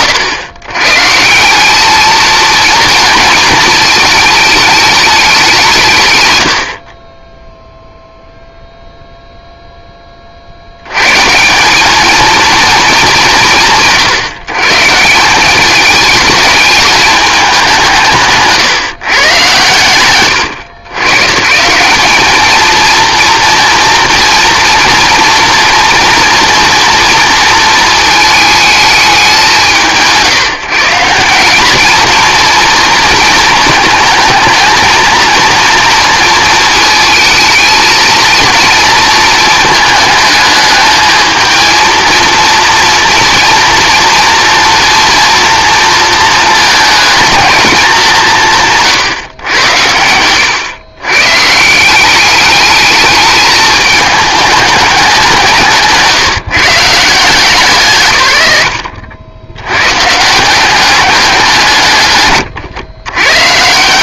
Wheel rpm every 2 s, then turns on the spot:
130, 230, 210, 50, 0, 90, 210, 160, 220, 140, 100, 230, 230, 230, 210, 180, 230, 230, 230, 230, 220, 230, 230, 220, 160, 120, 210, 210, 160, 90, 190, 140.
6-8